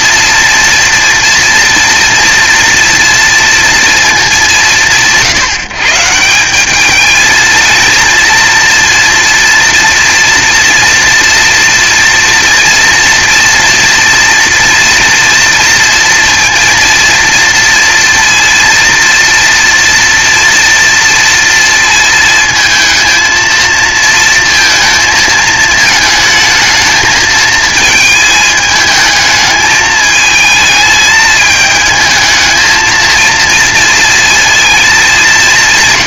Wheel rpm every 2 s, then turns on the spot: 230, 230, 170, 210, 230, 230, 230, 240, 230, 230, 230, 220, 230, 220, 220, 220, 220, 220.
none